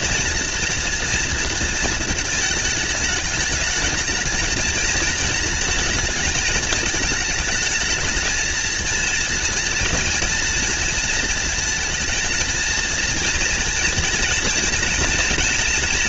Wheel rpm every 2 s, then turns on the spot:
230, 210, 220, 220, 230, 230, 230, 230.
none